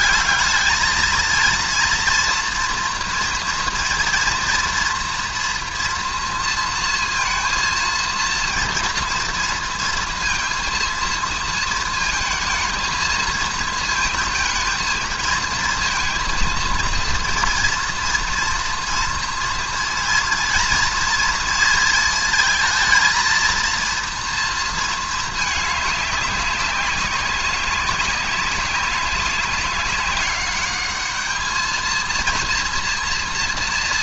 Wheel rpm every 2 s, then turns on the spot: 200, 230, 230, 230, 230, 230, 230, 230, 230, 240, 230, 230, 230, 190, 200, 200, 230.
none